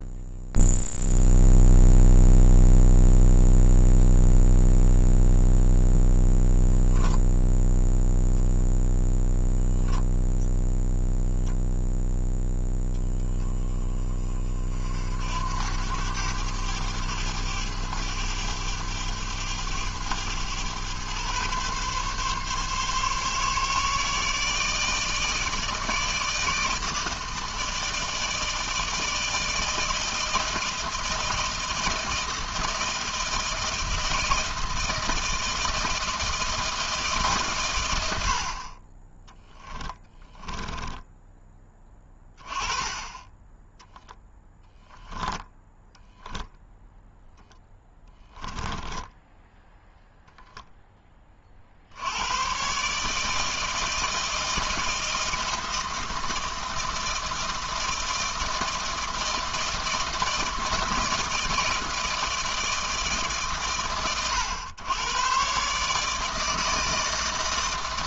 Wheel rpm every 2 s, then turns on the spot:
0, 0, 0, 0, 0, 0, 10, 60, 100, 100, 120, 140, 150, 160, 160, 160, 160, 160, 160, 30, 10, 20, 20, 0, 10, 10, 140, 160, 160, 160, 160, 160, 110, 160.
40-42 44-46 48-50